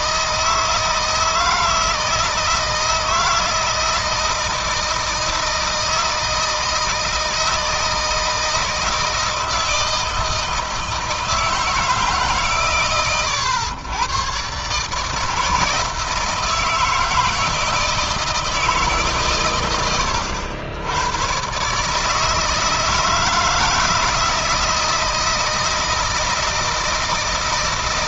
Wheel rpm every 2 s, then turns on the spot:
160, 160, 160, 160, 160, 160, 120, 140, 160, 150, 100, 160, 160, 160.
none